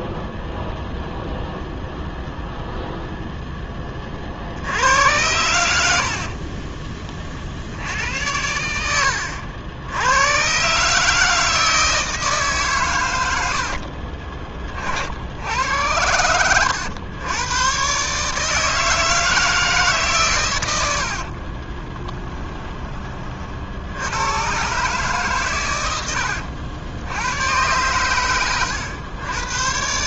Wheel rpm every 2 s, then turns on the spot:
0, 0, 80, 30, 90, 140, 130, 50, 100, 160, 100, 20, 130, 90, 100.
6-8